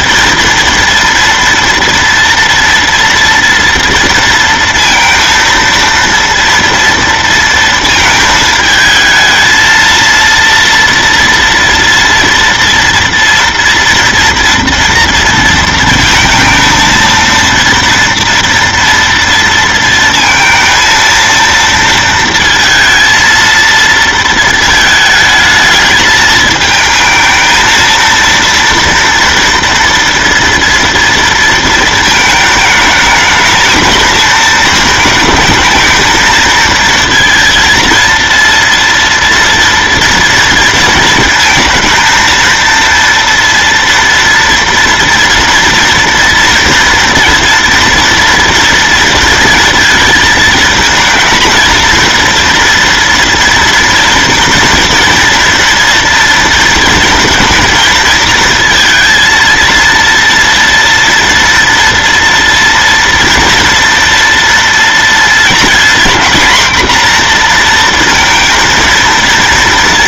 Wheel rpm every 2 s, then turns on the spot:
230, 230, 230, 230, 220, 230, 230, 230, 230, 230, 230, 230, 220, 220, 230, 230, 220, 220, 230, 230, 230, 230, 230, 230, 230, 230, 230, 230, 230, 220, 230, 230, 230, 240, 230.
none